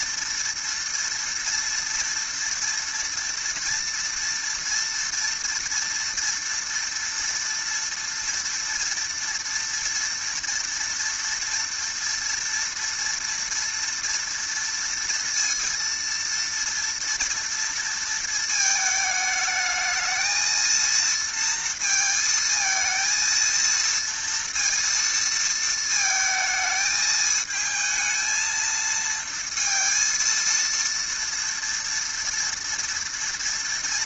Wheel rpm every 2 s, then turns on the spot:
230, 230, 240, 230, 230, 230, 230, 230, 230, 220, 230, 230, 230, 220, 230, 230, 230.
none